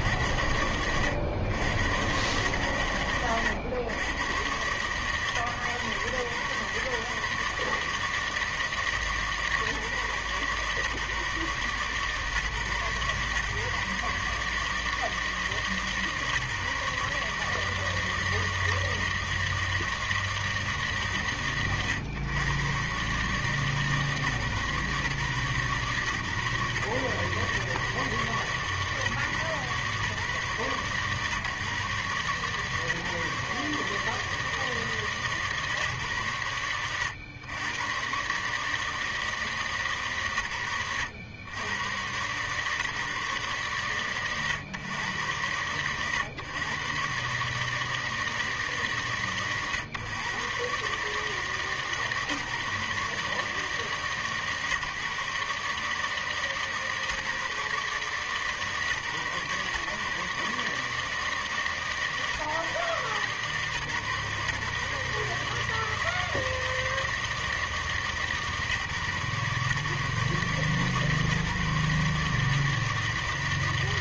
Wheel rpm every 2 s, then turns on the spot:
40, 110, 110, 120, 160, 140, 140, 150, 140, 160, 160, 120, 150, 130, 140, 140, 140, 160, 120, 130, 110, 120, 110, 110, 160, 110, 140, 140, 140, 140, 140, 150, 140, 160, 150, 140, 150.
none